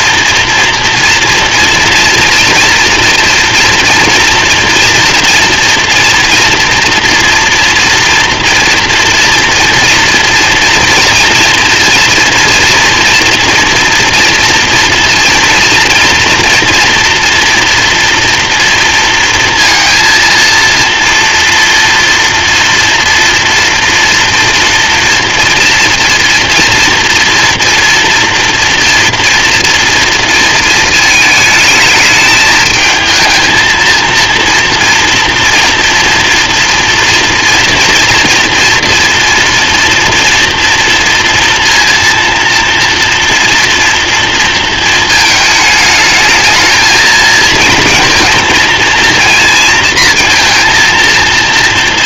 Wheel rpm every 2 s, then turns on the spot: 230, 230, 230, 230, 230, 230, 230, 230, 230, 230, 230, 230, 230, 240, 240, 230, 220, 230, 230, 230, 230, 230, 230, 220, 230, 230.
none